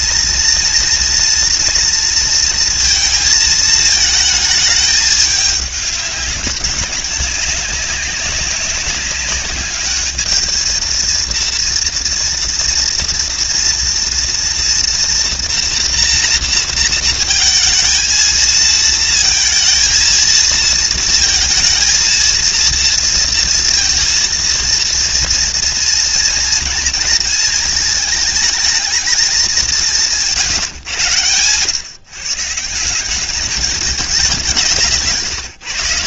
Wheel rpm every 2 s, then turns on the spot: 230, 230, 210, 200, 200, 230, 230, 230, 230, 230, 230, 230, 230, 230, 220, 130, 190, 160.
none